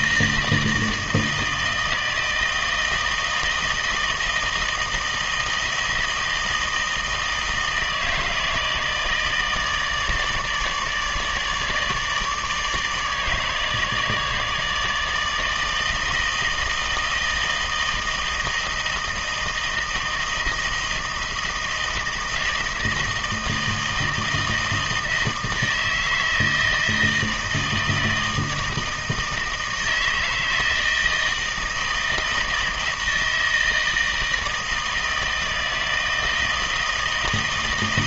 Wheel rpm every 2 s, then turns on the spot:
160, 160, 160, 160, 160, 150, 150, 150, 160, 160, 160, 160, 160, 160, 160, 160, 160, 160, 160.
none